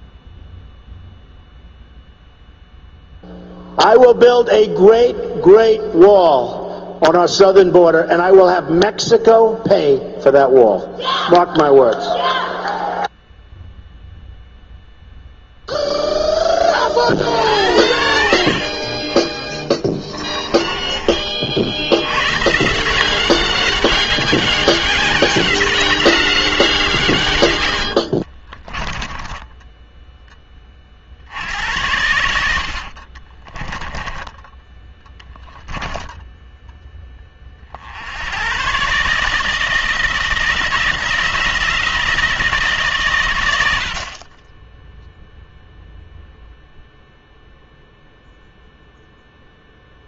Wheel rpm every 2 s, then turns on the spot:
0, 0, 0, 0, 0, 0, 0, 0, 30, 40, 30, 170, 190, 150, 10, 40, 60, 10, 10, 130, 170, 140, 0, 0, 0.
18-22 28-30 32-34